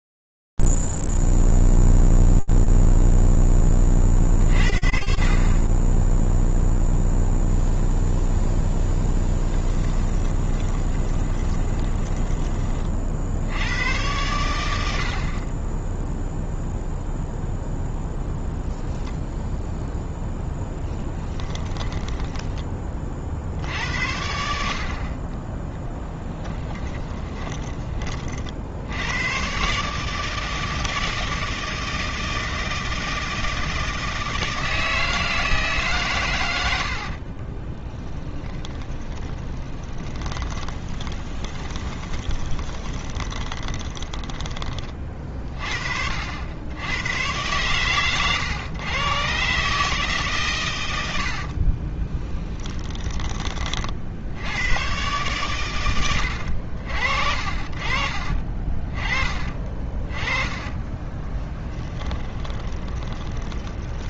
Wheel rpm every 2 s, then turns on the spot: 0, 0, 20, 0, 0, 20, 30, 60, 0, 0, 10, 30, 50, 20, 80, 160, 160, 160, 60, 20, 20, 20, 40, 110, 130, 70, 20, 120, 50, 30, 10, 20.
10-12 20-22 26-28 36-44 50-52 60-64